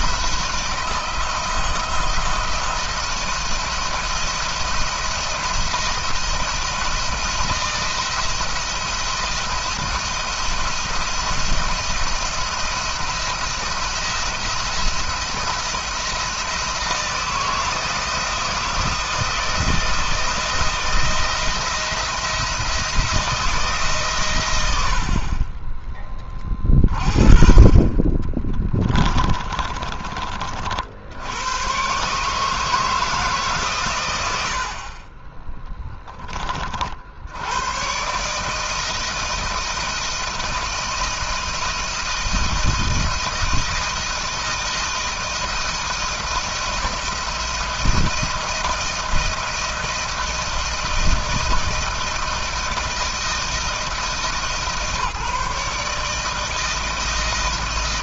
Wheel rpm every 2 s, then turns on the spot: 160, 170, 170, 170, 170, 170, 170, 170, 160, 160, 170, 170, 80, 40, 20, 70, 160, 40, 60, 160, 170, 170, 170, 170, 170, 170, 170, 150, 160.
28-30